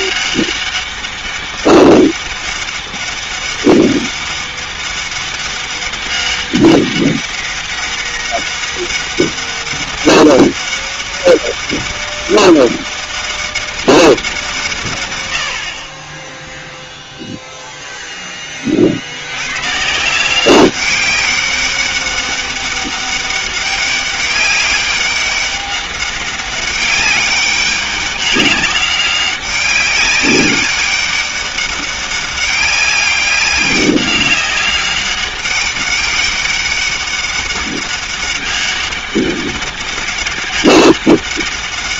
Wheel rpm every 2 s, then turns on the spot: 200, 200, 200, 200, 200, 200, 200, 120, 0, 30, 190, 200, 200, 190, 200, 200, 200, 200, 200, 190, 200.
none